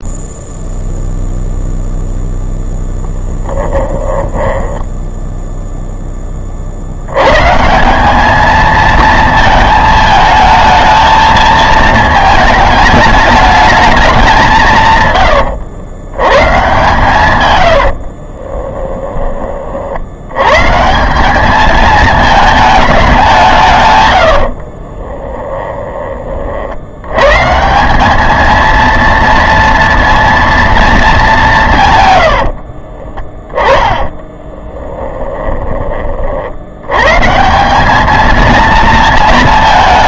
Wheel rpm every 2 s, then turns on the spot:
0, 0, 10, 50, 220, 220, 220, 160, 130, 20, 130, 220, 50, 60, 220, 230, 60, 20, 100, 230.
4-6 18-20 24-26 32-36